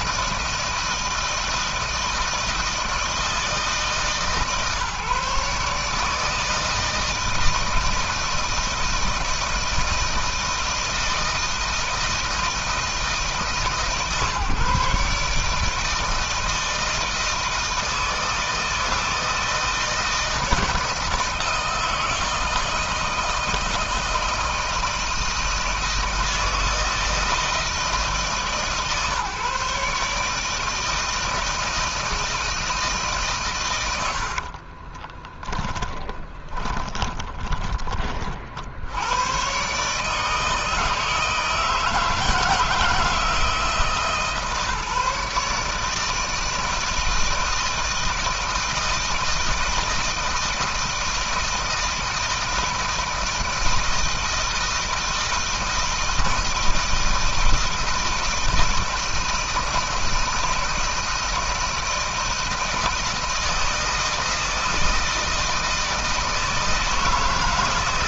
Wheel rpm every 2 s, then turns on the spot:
160, 160, 150, 160, 160, 160, 160, 140, 160, 160, 160, 160, 160, 160, 140, 160, 150, 30, 30, 80, 160, 160, 150, 160, 160, 160, 160, 160, 160, 160, 160, 160, 160, 160.
34-38